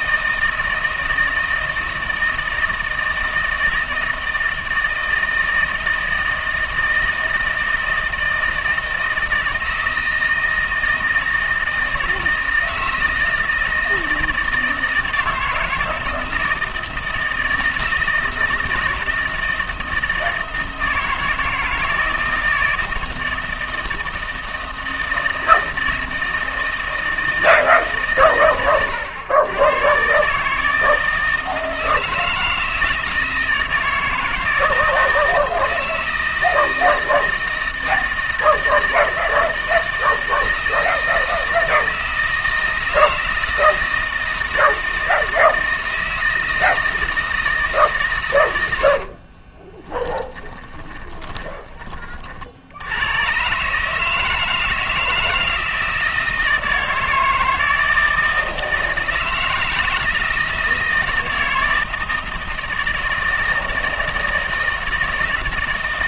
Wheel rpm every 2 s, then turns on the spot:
160, 160, 160, 160, 160, 160, 160, 160, 160, 160, 160, 160, 160, 160, 120, 160, 160, 160, 160, 160, 160, 160, 160, 160, 100, 10, 80, 160, 160, 160, 160, 160, 160.
50-52